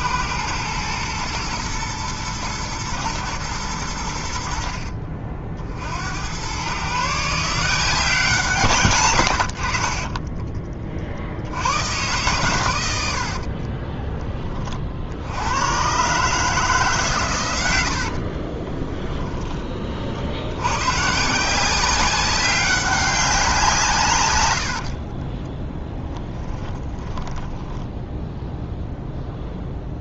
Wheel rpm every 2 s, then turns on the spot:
110, 110, 70, 120, 130, 20, 100, 30, 150, 30, 110, 200, 60, 10, 0.
4-6 18-20 26-28